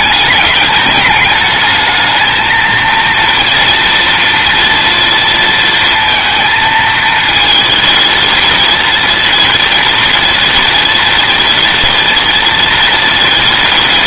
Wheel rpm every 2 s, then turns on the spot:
210, 230, 230, 220, 230, 220, 220.
none